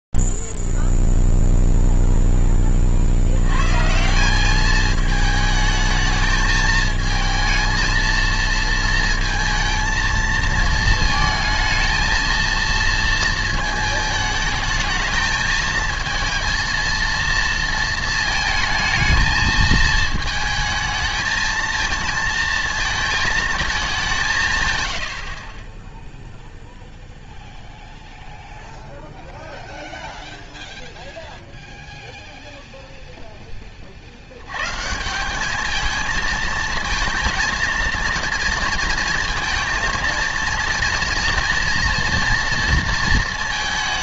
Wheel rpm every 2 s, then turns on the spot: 0, 0, 120, 220, 220, 230, 220, 220, 220, 230, 220, 220, 200, 10, 0, 0, 0, 100, 230, 230, 230, 230.
none